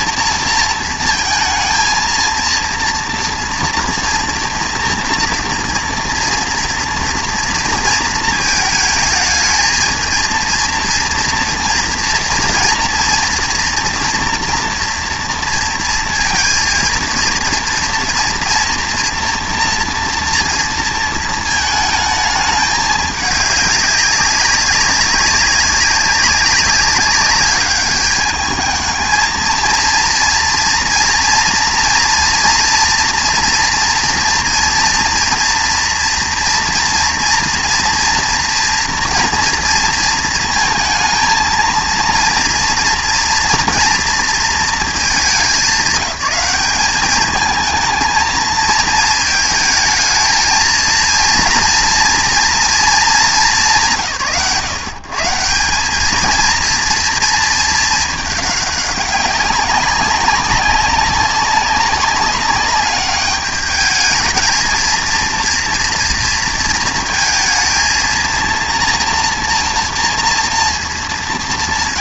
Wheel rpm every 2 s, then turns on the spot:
220, 230, 230, 230, 220, 230, 230, 230, 230, 240, 230, 210, 200, 200, 220, 230, 230, 230, 240, 230, 220, 230, 210, 190, 220, 230, 230, 130, 230, 200, 190, 200, 220, 230, 230, 230.
none